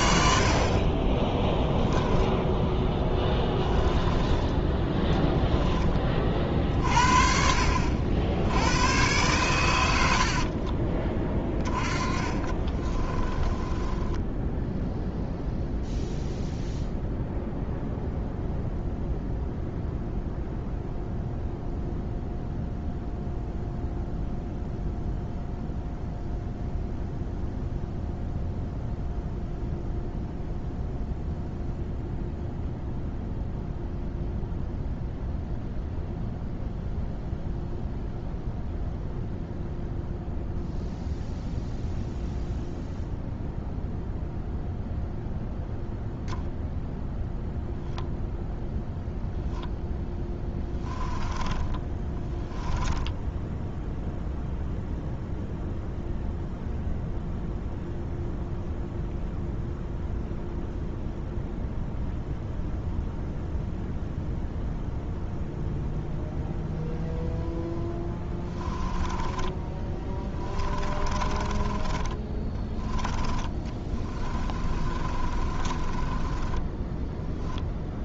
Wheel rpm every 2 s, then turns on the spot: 40, 10, 10, 40, 110, 30, 30, 0, 0, 0, 0, 0, 0, 0, 0, 0, 0, 0, 0, 0, 0, 0, 0, 0, 0, 10, 10, 0, 0, 0, 0, 0, 0, 0, 20, 30, 10, 30, 10.
2-4 10-14 50-54 68-72 74-78